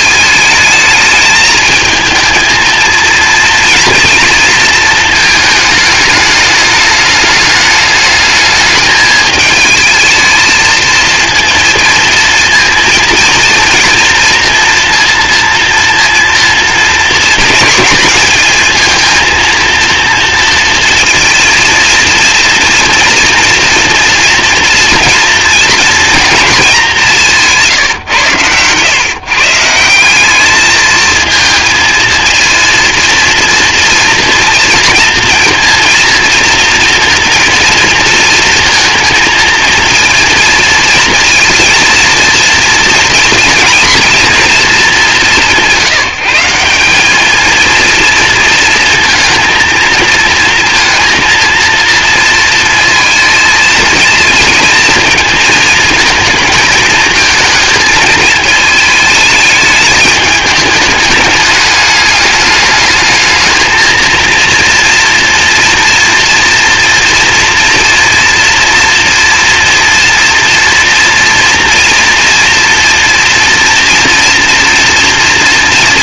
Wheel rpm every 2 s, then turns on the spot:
220, 230, 220, 210, 210, 230, 230, 230, 220, 220, 230, 230, 230, 210, 120, 220, 230, 230, 230, 230, 230, 230, 210, 190, 230, 230, 230, 220, 220, 220, 210, 210, 230, 230, 230, 230, 230, 230.
none